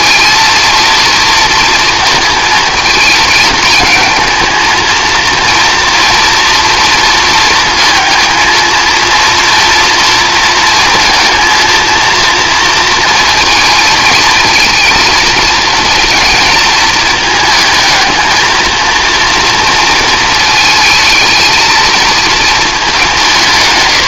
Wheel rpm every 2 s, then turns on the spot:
230, 230, 220, 230, 230, 220, 230, 230, 220, 220, 220, 210.
none